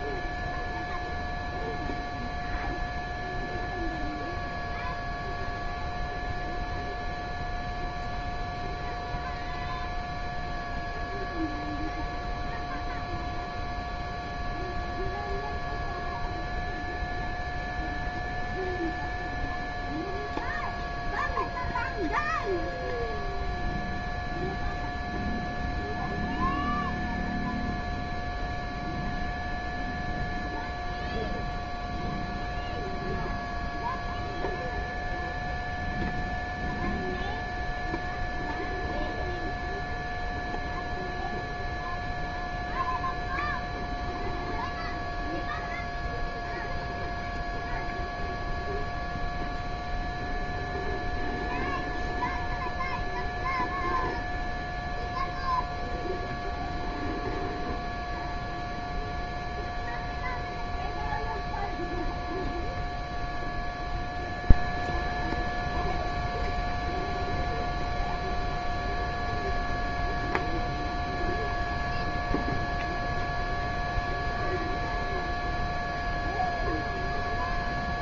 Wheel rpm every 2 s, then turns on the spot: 0, 0, 0, 0, 0, 0, 0, 0, 0, 0, 0, 0, 0, 0, 0, 0, 0, 0, 0, 0, 0, 0, 0, 0, 0, 0, 0, 0, 0, 0, 0, 0, 0, 0, 0, 0, 0, 0, 0.
none